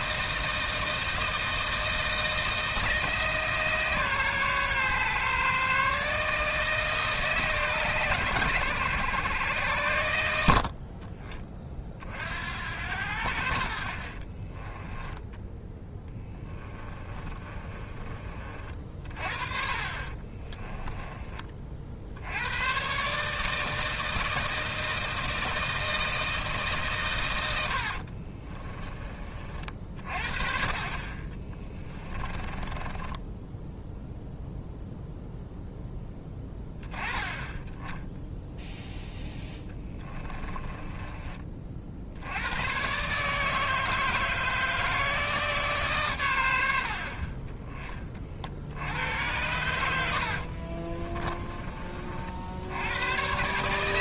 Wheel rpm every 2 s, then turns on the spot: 160, 160, 140, 150, 110, 50, 80, 10, 20, 40, 20, 120, 160, 140, 30, 40, 20, 0, 10, 0, 20, 130, 160, 70, 80, 30, 90.
16-18 20-22 32-34 40-42 50-52